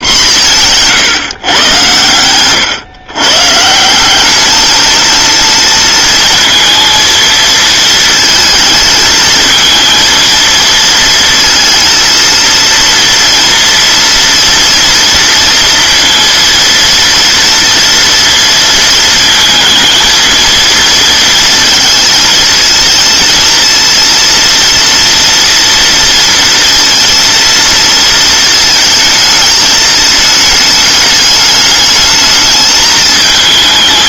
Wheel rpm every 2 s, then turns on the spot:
160, 130, 220, 230, 220, 230, 230, 230, 230, 230, 230, 220, 230, 230, 220, 210, 210.
0-2